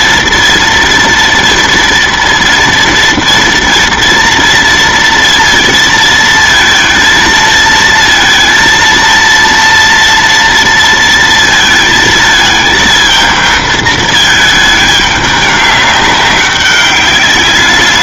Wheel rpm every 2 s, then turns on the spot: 230, 230, 230, 230, 230, 230, 220, 210, 200.
none